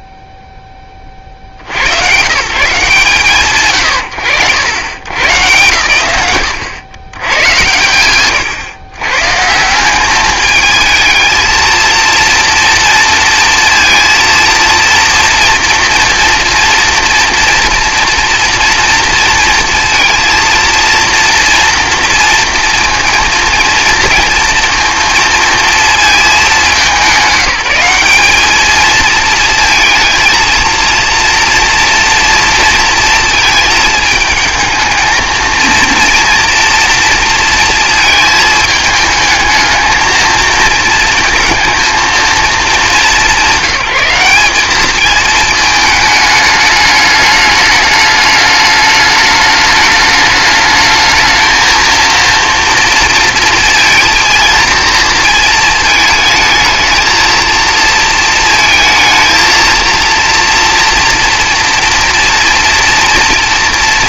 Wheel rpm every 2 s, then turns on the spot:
20, 150, 110, 120, 110, 220, 230, 230, 230, 230, 230, 230, 230, 190, 220, 230, 230, 220, 230, 220, 220, 210, 210, 210, 210, 210, 230, 230, 220, 230, 230, 230.
none